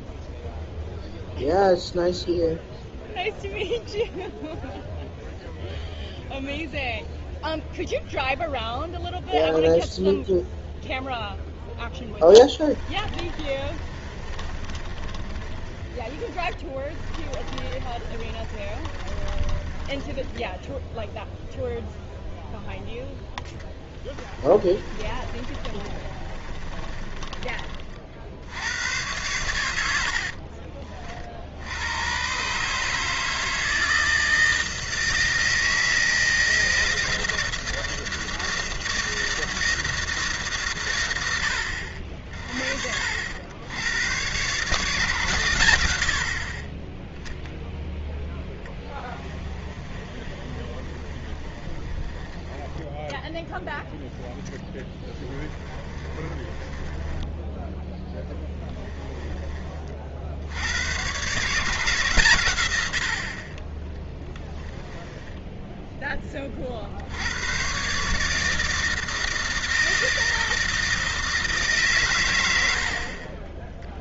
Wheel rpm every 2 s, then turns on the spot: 0, 0, 0, 0, 0, 0, 20, 30, 20, 30, 10, 0, 30, 20, 90, 40, 150, 160, 160, 160, 110, 50, 140, 30, 10, 30, 20, 10, 20, 10, 70, 120, 10, 30, 150, 160, 80.
12-20 24-28 48-60 64-66